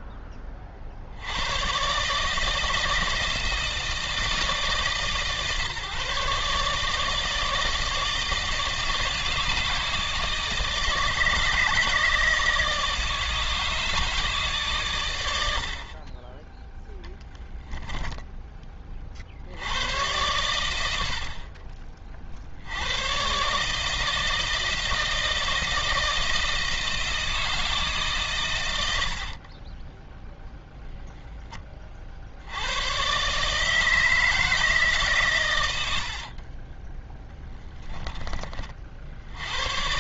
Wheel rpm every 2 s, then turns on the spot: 60, 160, 140, 150, 150, 150, 150, 120, 0, 40, 90, 90, 160, 160, 80, 0, 110, 150, 20, 50.
28-30 36-38